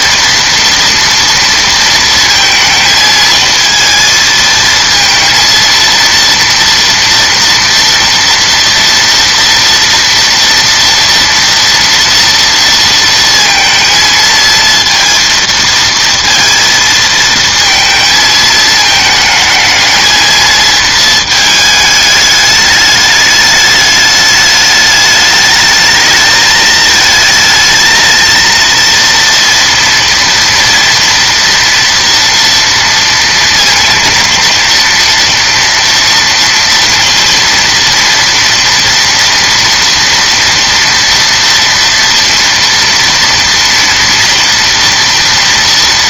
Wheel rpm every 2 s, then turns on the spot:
230, 220, 230, 230, 230, 230, 230, 230, 230, 220, 220, 210, 210, 220, 230, 230, 230, 230, 230, 230, 230, 230, 230.
none